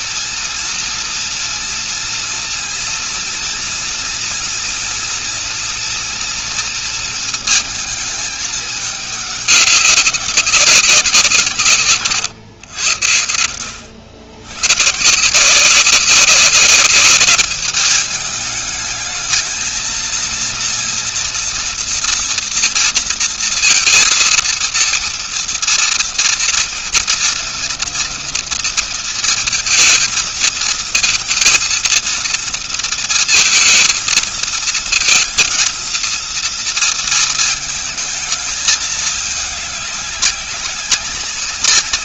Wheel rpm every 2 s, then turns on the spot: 240, 230, 240, 230, 210, 200, 120, 110, 200, 210, 230, 230, 230, 230, 230, 220, 230, 230, 230, 210, 200.
none